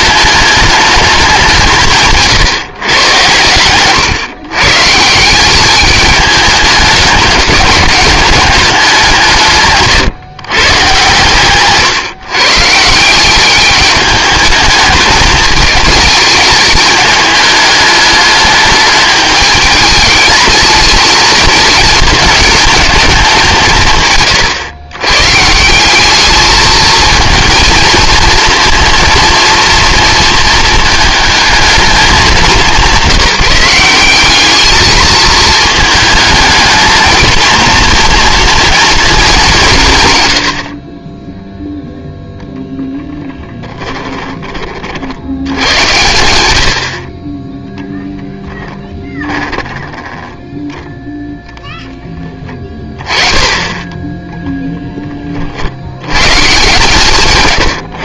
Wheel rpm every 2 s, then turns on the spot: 210, 130, 140, 210, 190, 120, 150, 210, 210, 210, 220, 210, 120, 220, 230, 230, 190, 210, 230, 230, 40, 0, 50, 60, 10, 0, 30, 10, 150.
48-50